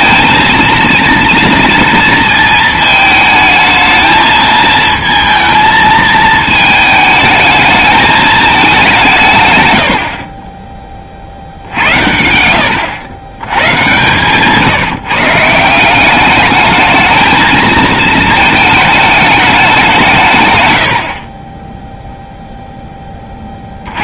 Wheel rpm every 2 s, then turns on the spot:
230, 220, 220, 220, 210, 30, 90, 140, 210, 220, 130, 0.
none